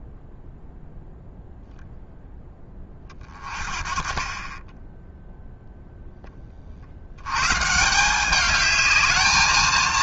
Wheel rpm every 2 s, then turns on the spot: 0, 30, 10, 70, 210.
none